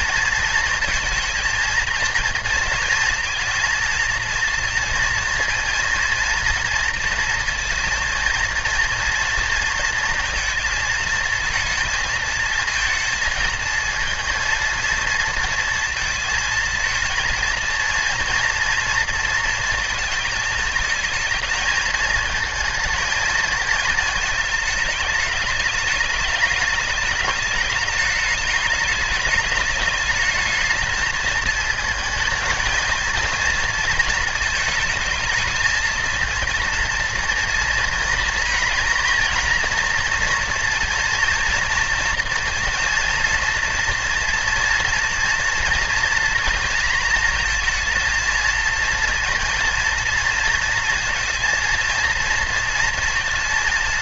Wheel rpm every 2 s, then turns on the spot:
230, 230, 230, 230, 230, 230, 230, 230, 230, 230, 220, 220, 210, 210, 210, 220, 220, 230, 230, 230, 230, 240, 230, 230, 230, 230, 230.
none